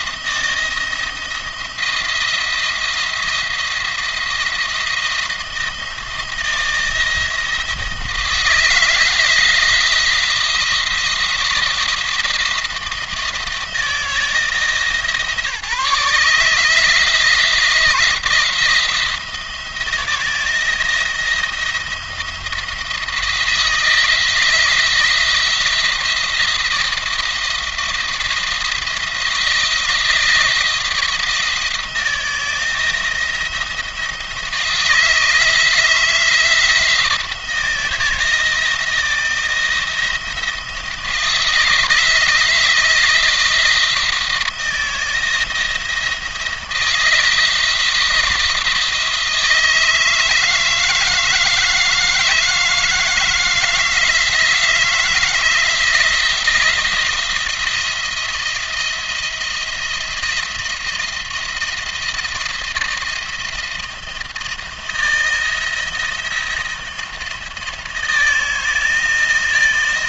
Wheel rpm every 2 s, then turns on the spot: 170, 170, 170, 160, 160, 170, 160, 160, 160, 170, 170, 170, 160, 170, 170, 160, 160, 160, 170, 170, 170, 170, 160, 160, 170, 160, 160, 160, 160, 170, 170, 160, 170, 170, 170.
none